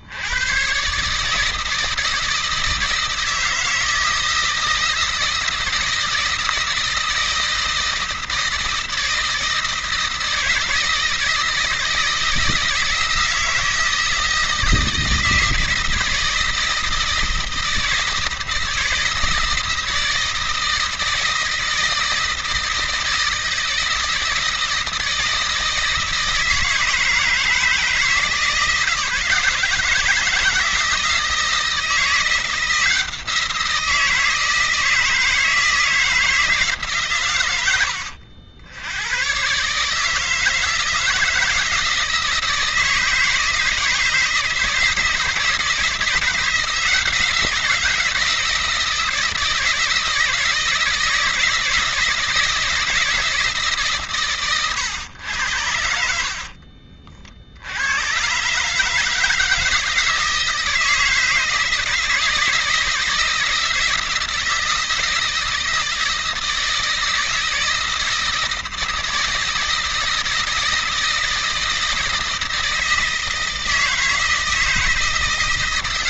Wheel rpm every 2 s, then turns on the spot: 120, 160, 160, 160, 160, 160, 160, 160, 170, 160, 160, 160, 160, 160, 170, 160, 170, 160, 150, 80, 160, 160, 160, 170, 160, 170, 170, 120, 50, 130, 160, 160, 160, 160, 160, 160, 160, 160.
56-58